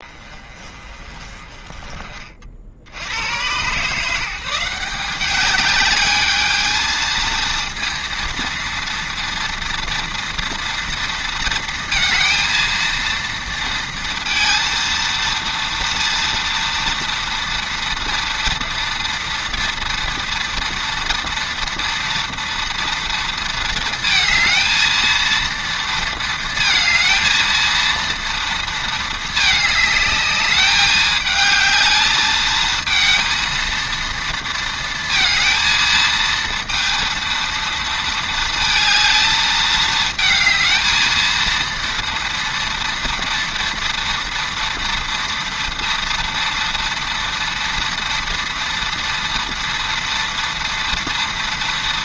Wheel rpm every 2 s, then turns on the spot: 30, 90, 190, 220, 230, 230, 230, 230, 230, 230, 240, 230, 230, 220, 220, 210, 220, 230, 230, 220, 230, 230, 230, 230, 230, 230.
none